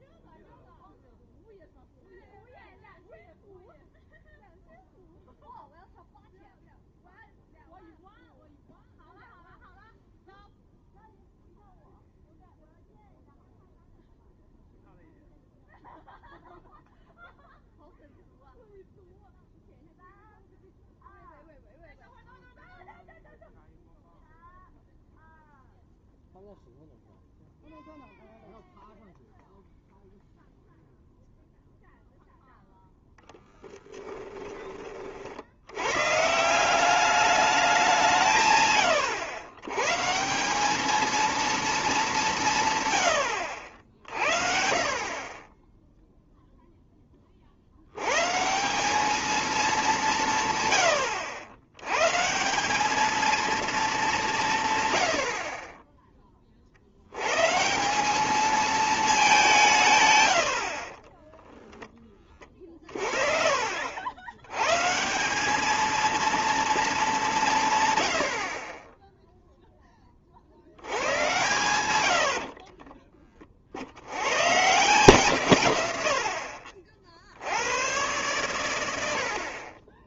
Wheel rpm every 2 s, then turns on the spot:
0, 0, 0, 0, 0, 0, 0, 0, 0, 0, 0, 0, 0, 0, 0, 0, 0, 20, 180, 120, 210, 130, 50, 0, 180, 110, 200, 140, 60, 220, 60, 40, 130, 220, 20, 80, 30, 160, 50, 100.
62-64 72-74